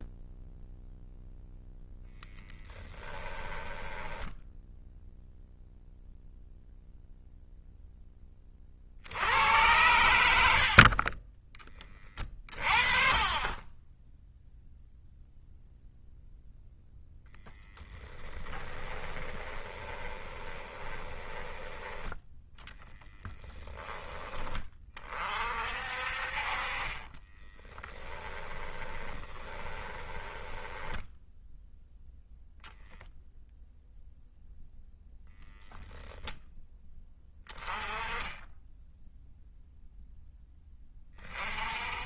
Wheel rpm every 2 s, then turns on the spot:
0, 10, 0, 0, 60, 50, 30, 0, 0, 10, 20, 10, 30, 30, 20, 10, 0, 0, 10, 10, 20.
2-4 10-12 18-24 26-32